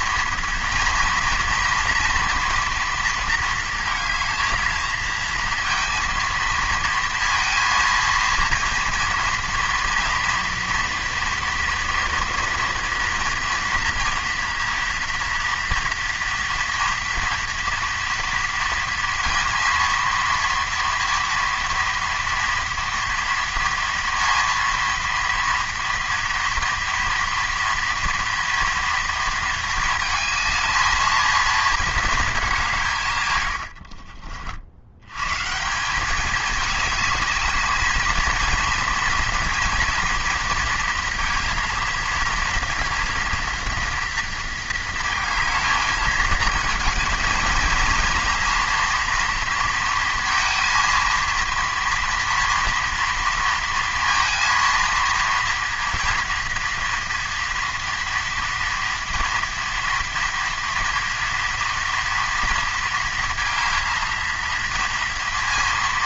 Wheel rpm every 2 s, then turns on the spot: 230, 230, 230, 230, 230, 230, 230, 230, 230, 230, 240, 230, 230, 230, 230, 220, 210, 70, 210, 230, 230, 230, 230, 230, 240, 230, 230, 230, 230, 240, 230, 230, 230.
none